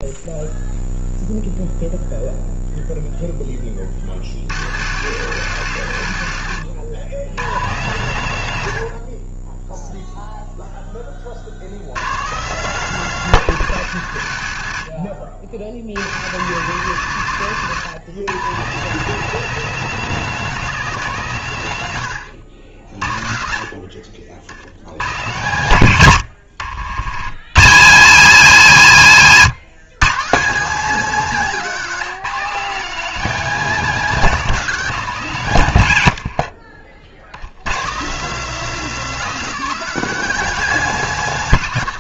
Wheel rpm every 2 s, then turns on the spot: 0, 0, 110, 100, 80, 10, 170, 70, 120, 160, 180, 70, 90, 60, 100, 200, 210, 210, 50, 240, 220.
none